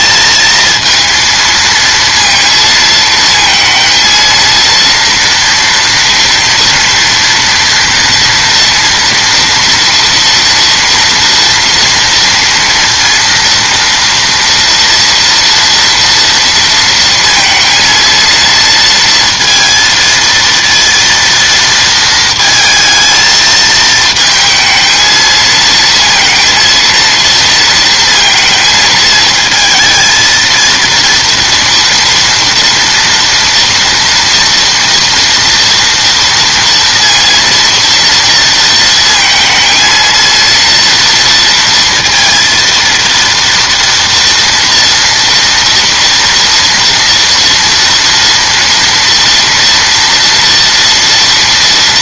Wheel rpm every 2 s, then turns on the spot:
230, 230, 230, 230, 230, 230, 230, 230, 230, 230, 230, 220, 220, 230, 220, 230, 230, 240, 230, 230, 230, 230, 230, 230, 230, 230.
none